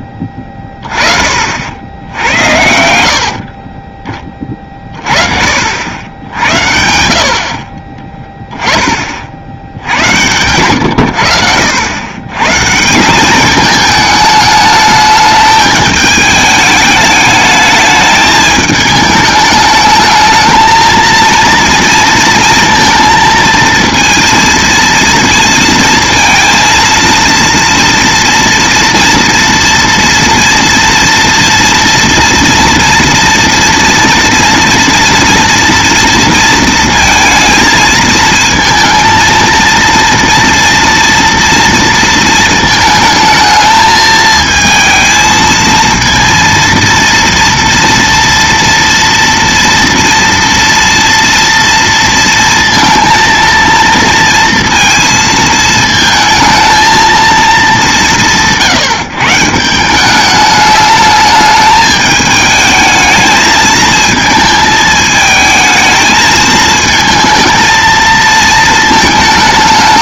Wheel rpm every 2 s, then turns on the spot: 10, 70, 30, 70, 20, 110, 150, 210, 210, 210, 220, 230, 230, 230, 230, 230, 230, 230, 230, 230, 230, 220, 220, 230, 230, 230, 230, 230, 230, 160, 210, 220, 220, 220, 220.
none